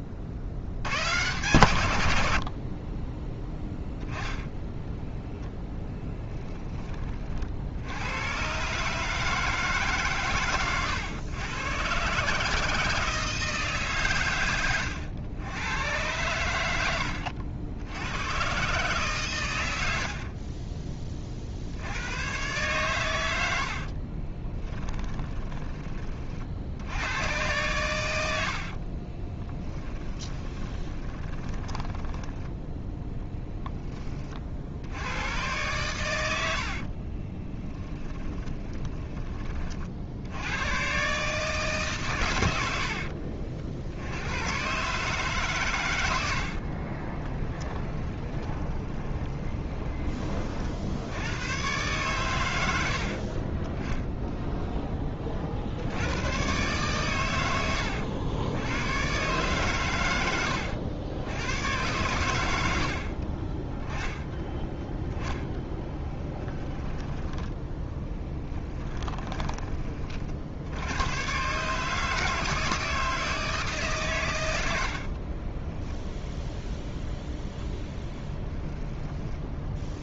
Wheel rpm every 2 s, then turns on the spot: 100, 50, 10, 20, 140, 110, 160, 100, 90, 130, 30, 120, 10, 90, 50, 20, 10, 70, 50, 20, 120, 80, 130, 50, 20, 60, 80, 10, 120, 100, 90, 70, 10, 20, 20, 80, 160, 70, 0, 10.
24-26 28-32 36-40 42-44 46-50 64-70 74-76 78-80